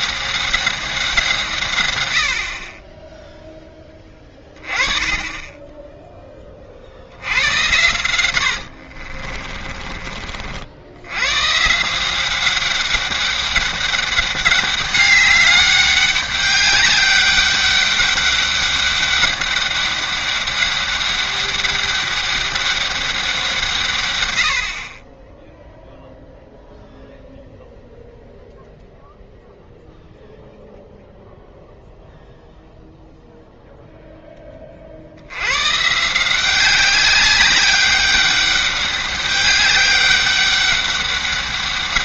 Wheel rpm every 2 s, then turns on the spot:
190, 30, 20, 50, 60, 80, 200, 200, 200, 200, 200, 200, 60, 0, 0, 0, 0, 40, 190, 200, 200.
8-10